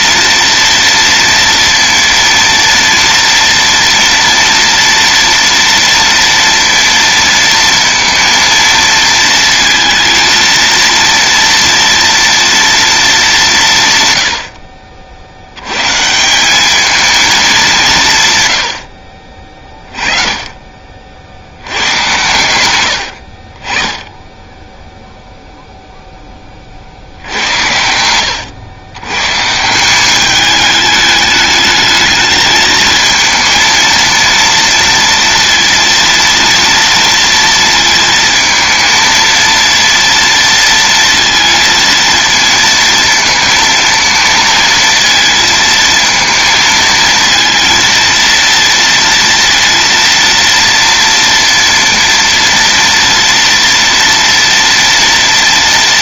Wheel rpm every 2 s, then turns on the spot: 230, 230, 230, 230, 230, 230, 230, 80, 180, 130, 30, 110, 10, 10, 100, 200, 220, 230, 230, 230, 230, 230, 230, 230, 230, 230, 230, 230.
none